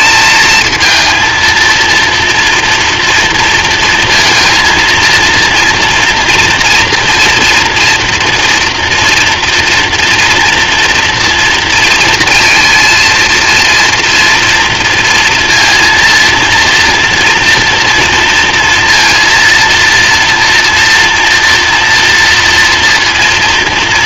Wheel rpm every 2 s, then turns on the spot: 220, 230, 230, 230, 230, 230, 230, 230, 230, 230, 230, 230.
none